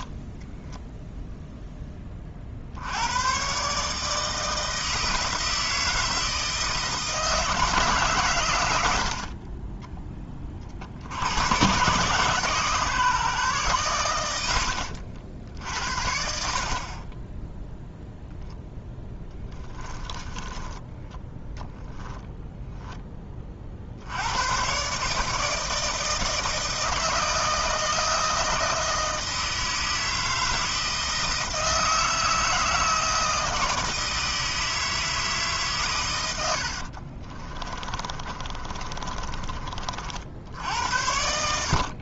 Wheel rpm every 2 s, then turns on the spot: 0, 70, 160, 160, 90, 50, 140, 90, 50, 0, 10, 10, 130, 160, 160, 160, 160, 160, 60, 30, 70.
14-16 20-22 36-40